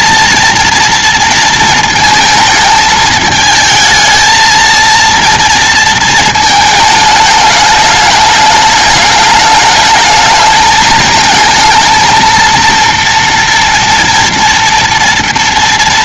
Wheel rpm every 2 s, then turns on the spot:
230, 220, 220, 220, 210, 220, 230, 230.
none